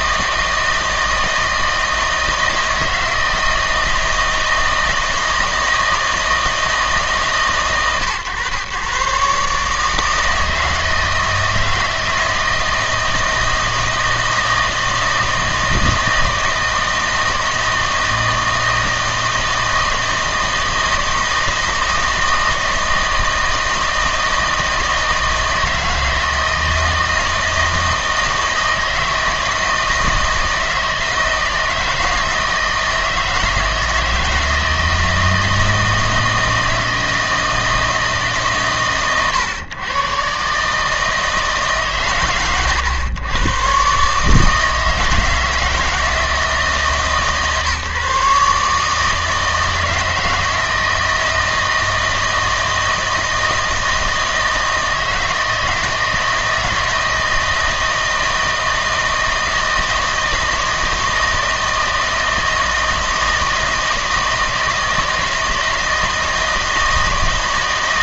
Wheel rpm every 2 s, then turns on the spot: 160, 160, 160, 160, 120, 160, 160, 160, 160, 160, 160, 160, 160, 160, 160, 160, 160, 160, 160, 130, 150, 120, 160, 160, 150, 160, 160, 160, 160, 160, 160, 160, 160, 160.
none